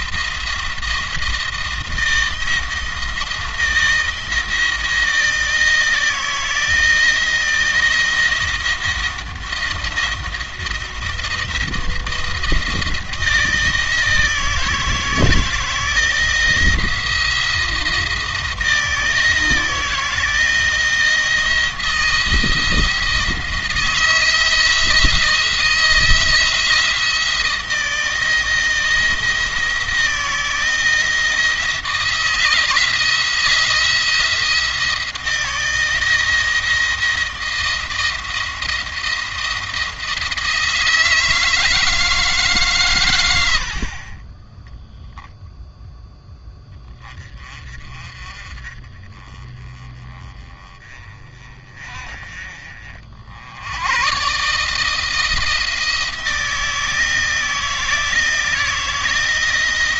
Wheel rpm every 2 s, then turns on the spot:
170, 170, 170, 160, 170, 170, 170, 160, 160, 160, 160, 160, 170, 170, 160, 160, 170, 160, 160, 170, 160, 130, 10, 20, 30, 30, 50, 150, 160, 160.
none